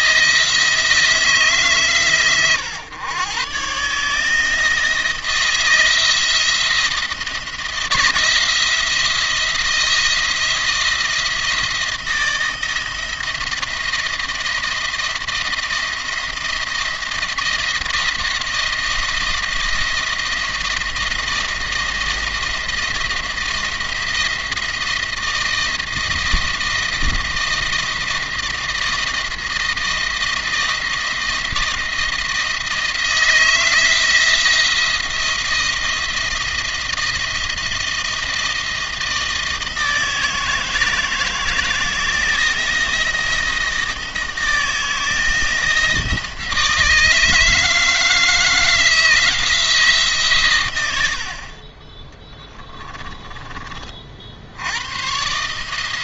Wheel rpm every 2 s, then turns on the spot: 160, 130, 160, 160, 160, 170, 160, 170, 170, 160, 160, 170, 170, 160, 160, 160, 160, 170, 170, 160, 160, 170, 160, 160, 160, 110, 30, 90.
52-54